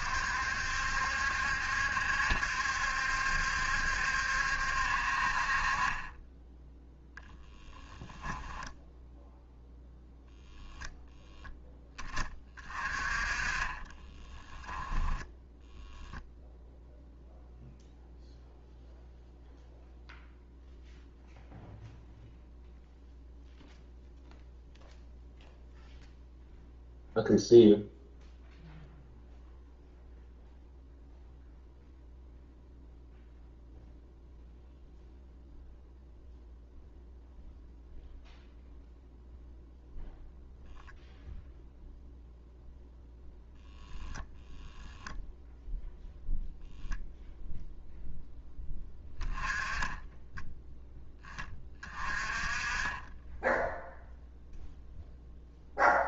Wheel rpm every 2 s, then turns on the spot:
70, 70, 50, 0, 0, 0, 30, 10, 0, 0, 0, 0, 0, 0, 0, 0, 0, 0, 0, 0, 0, 0, 0, 0, 10, 10, 30, 0.
14-16